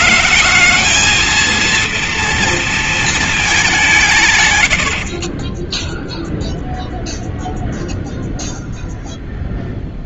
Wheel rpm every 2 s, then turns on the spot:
220, 230, 100, 0, 0.
none